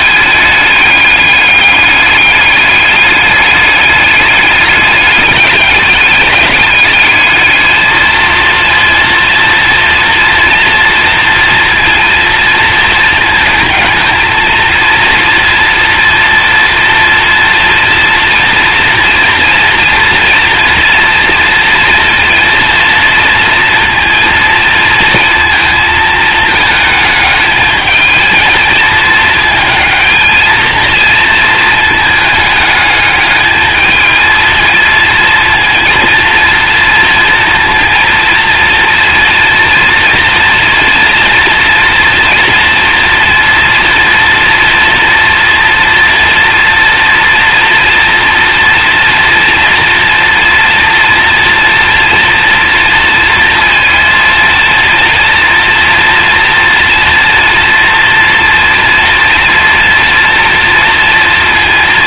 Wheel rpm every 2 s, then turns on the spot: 210, 200, 200, 210, 220, 230, 230, 220, 230, 230, 240, 230, 230, 220, 220, 220, 210, 220, 230, 230, 230, 240, 230, 230, 230, 230, 230, 230, 230, 230, 230.
none